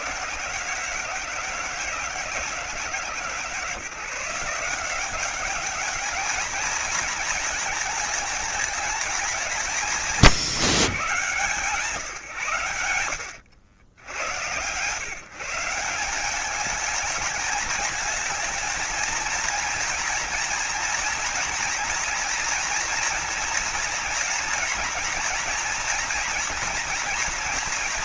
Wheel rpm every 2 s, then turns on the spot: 160, 150, 180, 220, 210, 140, 90, 140, 220, 230, 230, 240, 230, 230.
none